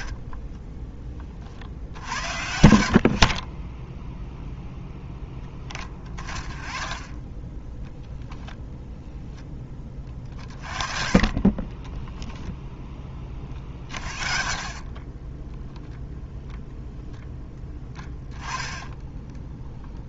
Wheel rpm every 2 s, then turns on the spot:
20, 60, 10, 30, 0, 30, 10, 20, 0, 10.
10-12